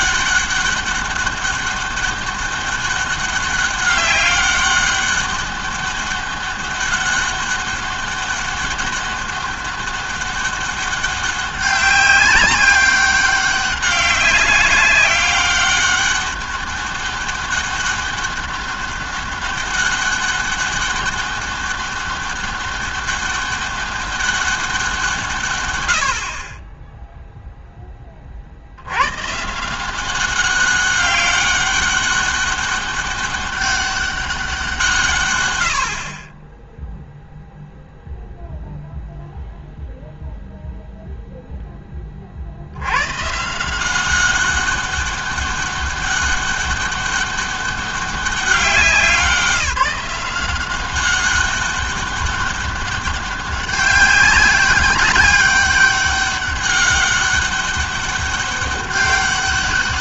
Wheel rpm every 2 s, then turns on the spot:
200, 200, 200, 200, 200, 200, 190, 190, 200, 200, 200, 200, 180, 20, 70, 200, 200, 170, 10, 0, 0, 90, 200, 200, 190, 190, 200, 200, 200, 200.
none